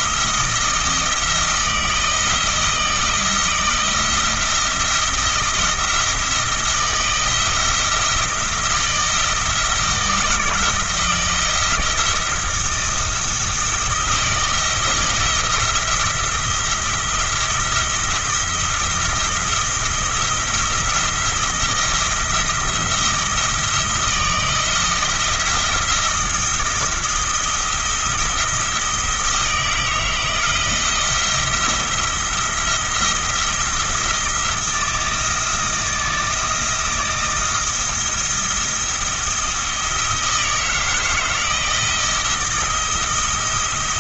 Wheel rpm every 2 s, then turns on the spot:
160, 170, 170, 160, 160, 170, 170, 170, 170, 170, 170, 170, 170, 170, 160, 160, 170, 160, 160, 170, 160, 170.
none